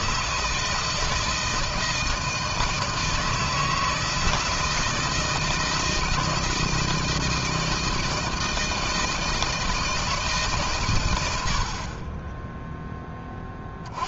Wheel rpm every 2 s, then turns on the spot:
160, 160, 160, 160, 160, 150, 10.
none